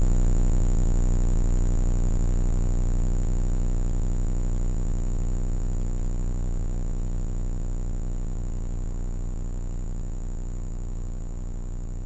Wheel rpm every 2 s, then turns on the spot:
0, 0, 0, 0, 0, 0.
none